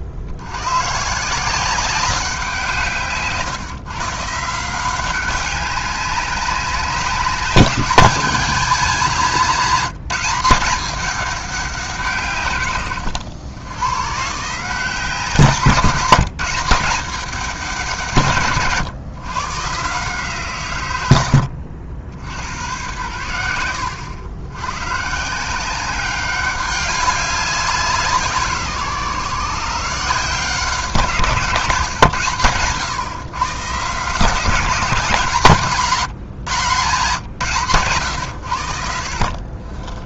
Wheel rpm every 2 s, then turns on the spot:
130, 170, 170, 190, 210, 210, 120, 160, 180, 140, 120, 100, 120, 190, 150, 160, 130, 160, 140, 70.
none